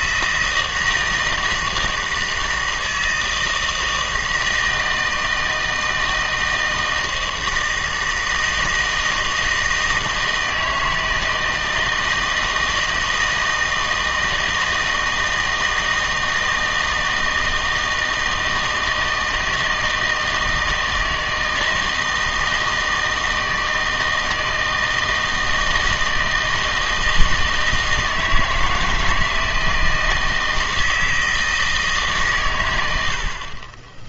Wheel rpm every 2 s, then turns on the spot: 160, 160, 160, 160, 160, 160, 160, 160, 160, 160, 160, 160, 160, 160, 160, 160, 100.
none